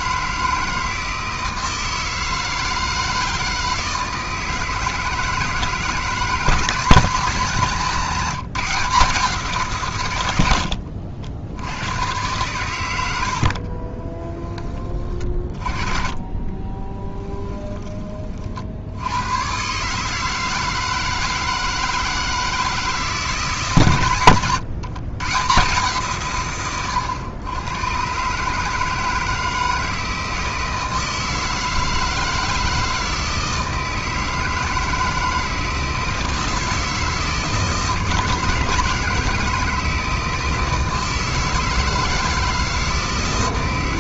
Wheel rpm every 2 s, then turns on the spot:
160, 160, 160, 180, 170, 60, 100, 20, 20, 60, 160, 160, 120, 130, 150, 160, 160, 160, 160, 160, 160, 150.
10-12 16-18